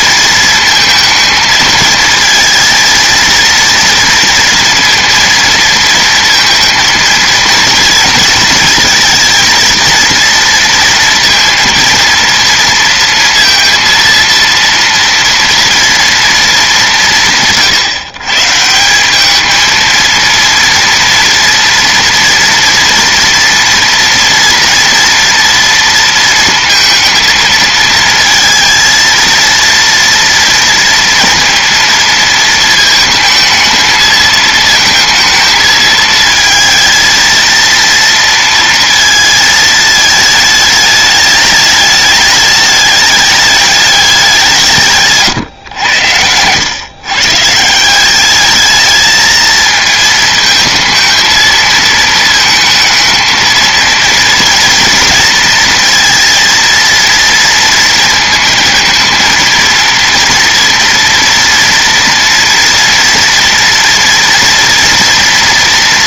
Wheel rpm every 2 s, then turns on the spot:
230, 230, 230, 230, 230, 230, 230, 230, 160, 200, 230, 230, 230, 230, 230, 230, 220, 220, 220, 230, 210, 210, 140, 130, 220, 220, 220, 230, 230, 230, 230, 230, 230.
none